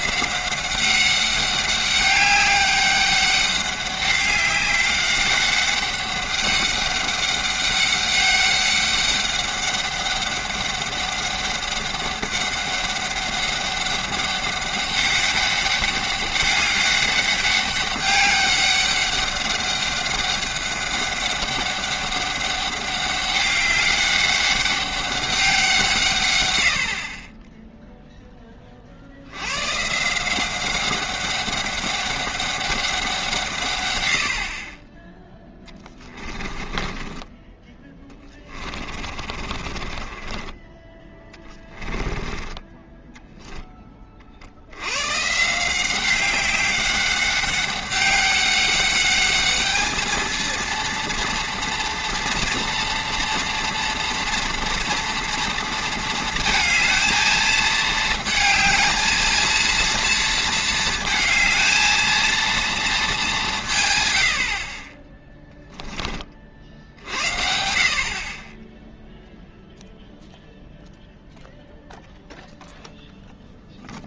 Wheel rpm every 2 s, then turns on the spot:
190, 200, 200, 200, 200, 200, 200, 200, 200, 200, 200, 200, 200, 60, 50, 190, 190, 20, 20, 30, 20, 10, 100, 200, 200, 230, 230, 230, 220, 230, 230, 210, 20, 70, 0, 0, 0.
36-40 42-44